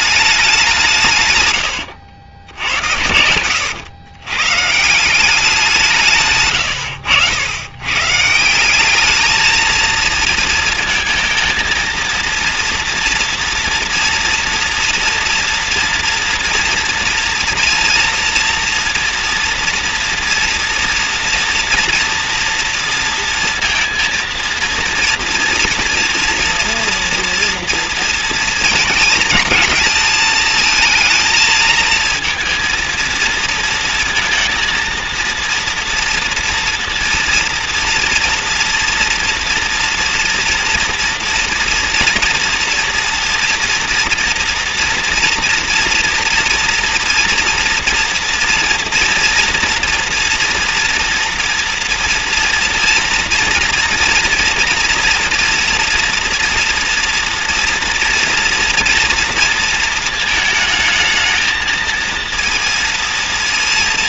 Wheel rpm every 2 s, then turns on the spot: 190, 90, 140, 110, 170, 230, 230, 230, 230, 230, 230, 230, 230, 230, 220, 220, 230, 230, 230, 230, 230, 230, 230, 240, 230, 230, 230, 230, 230, 230, 220, 230.
none